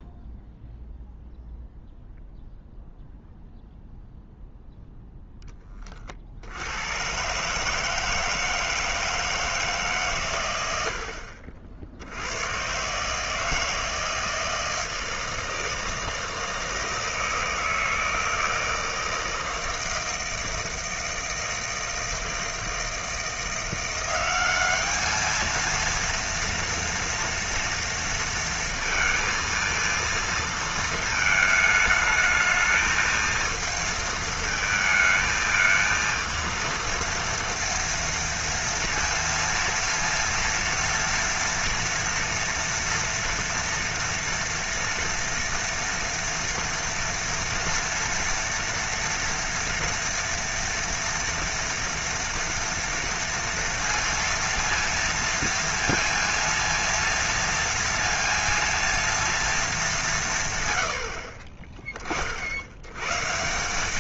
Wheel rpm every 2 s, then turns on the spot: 0, 0, 0, 90, 160, 80, 120, 160, 160, 160, 160, 160, 200, 230, 230, 230, 220, 220, 230, 230, 230, 230, 230, 240, 230, 240, 230, 230, 230, 230, 100, 90.
none